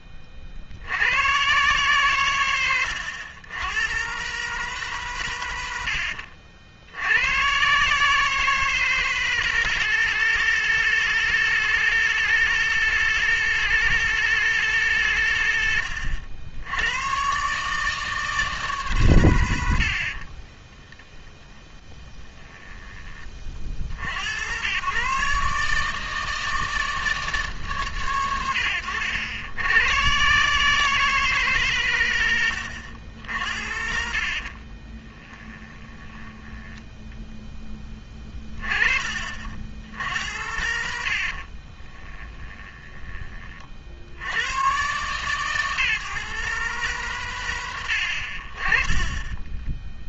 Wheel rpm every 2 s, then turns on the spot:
60, 110, 150, 70, 160, 160, 160, 150, 80, 150, 20, 20, 110, 160, 100, 150, 100, 40, 10, 30, 90, 20, 130, 150, 40.
20-24 34-38 42-44